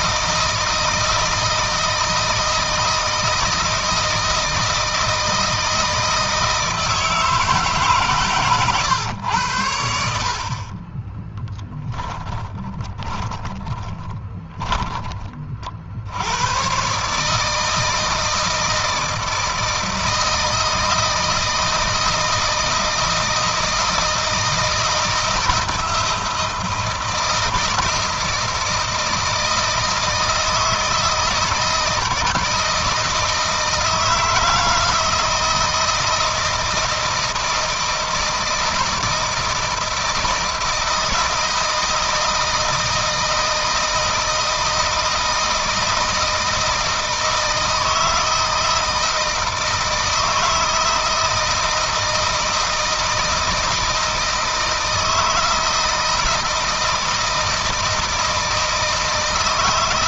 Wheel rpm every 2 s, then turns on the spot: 160, 160, 160, 160, 110, 30, 20, 20, 120, 160, 170, 160, 170, 160, 160, 160, 160, 160, 160, 160, 160, 160, 160, 160, 160, 160, 160, 160, 160, 160.
10-14